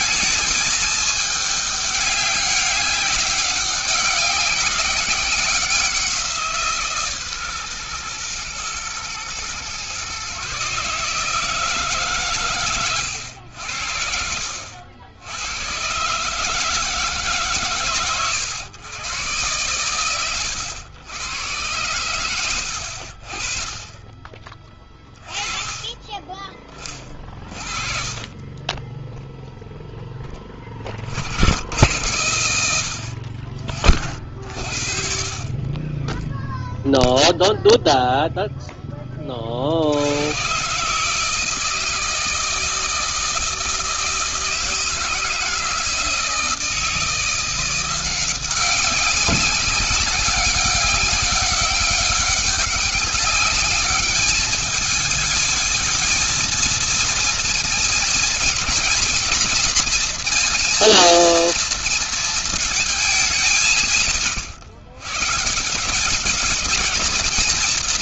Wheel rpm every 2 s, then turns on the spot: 220, 200, 190, 160, 120, 140, 130, 70, 160, 110, 90, 80, 20, 20, 20, 30, 100, 60, 0, 10, 120, 160, 160, 160, 190, 190, 200, 210, 230, 230, 230, 230, 130, 210.
none